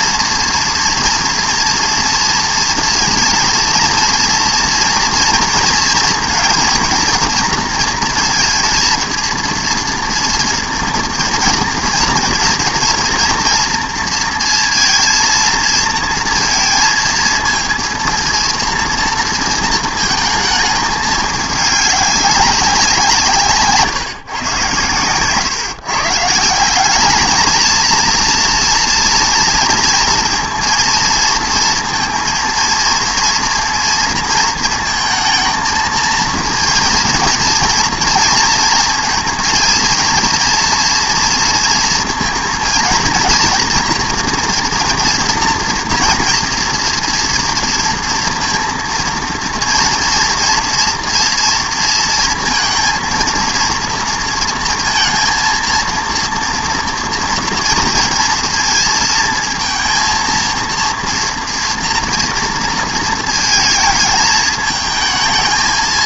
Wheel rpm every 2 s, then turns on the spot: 230, 230, 230, 230, 230, 230, 230, 230, 230, 230, 220, 190, 130, 170, 230, 230, 230, 230, 230, 230, 230, 230, 240, 230, 230, 240, 230, 230, 230, 230, 230, 230, 220.
none